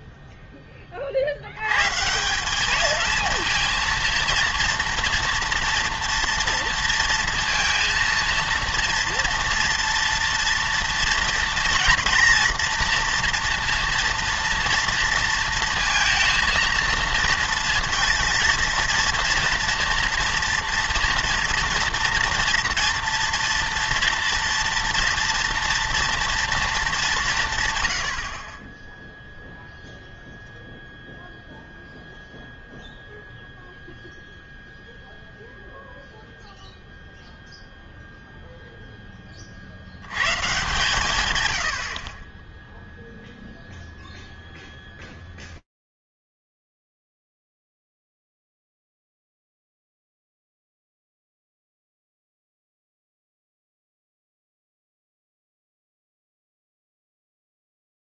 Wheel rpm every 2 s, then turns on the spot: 10, 200, 230, 230, 230, 230, 230, 230, 230, 230, 230, 240, 230, 220, 20, 0, 0, 0, 0, 0, 130, 10, 0, 90, 180, 0, 0, 0, 0.
none